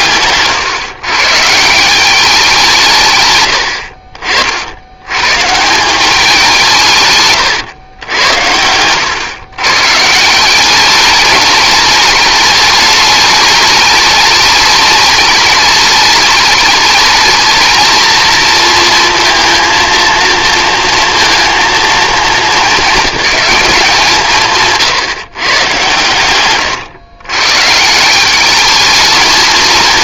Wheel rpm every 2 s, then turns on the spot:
130, 180, 80, 160, 100, 190, 210, 210, 210, 230, 230, 210, 150, 120, 210.
24-26